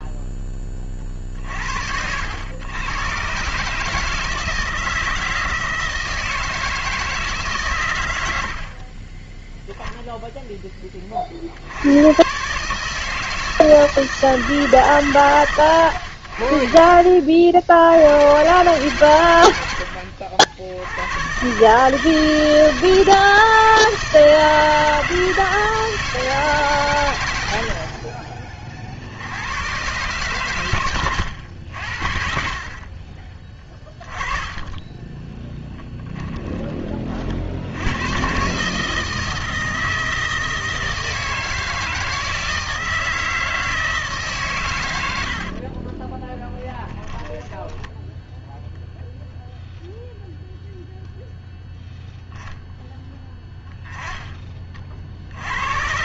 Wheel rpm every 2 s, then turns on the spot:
20, 110, 160, 160, 40, 10, 150, 150, 60, 120, 80, 160, 160, 140, 40, 120, 50, 10, 20, 150, 160, 160, 130, 10, 0, 0, 0, 30.
16-18 34-36 46-48